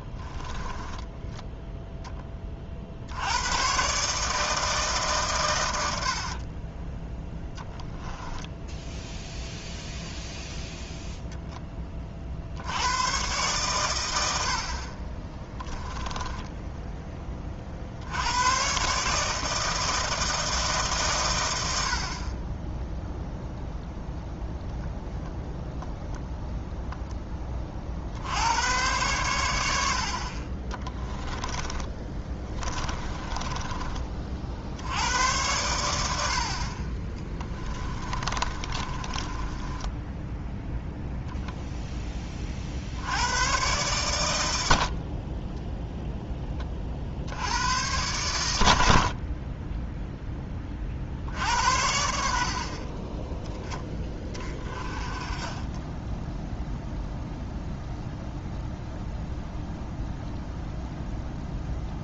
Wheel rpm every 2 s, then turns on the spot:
10, 50, 150, 20, 0, 0, 100, 50, 10, 130, 150, 10, 0, 0, 100, 30, 20, 70, 40, 30, 0, 60, 70, 30, 80, 40, 40, 20, 0, 0, 0.
0-2 6-8 30-34 38-40